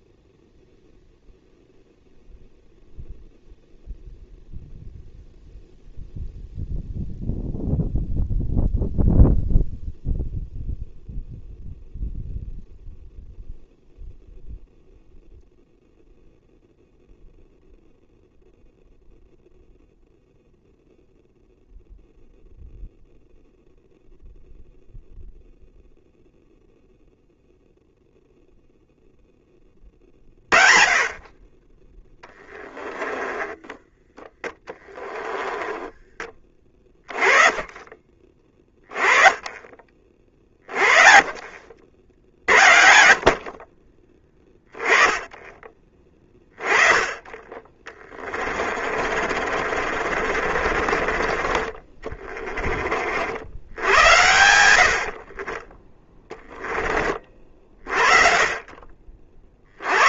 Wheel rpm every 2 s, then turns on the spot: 0, 0, 0, 0, 0, 0, 0, 0, 0, 0, 0, 0, 0, 0, 0, 30, 10, 10, 20, 20, 30, 50, 10, 20, 40, 40, 40, 70, 30, 40.
32-34 48-52